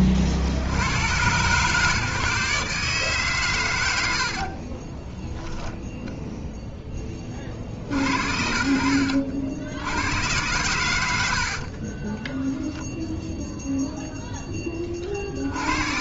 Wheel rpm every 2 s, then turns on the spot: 70, 140, 50, 0, 70, 100, 10, 30.
4-6 12-14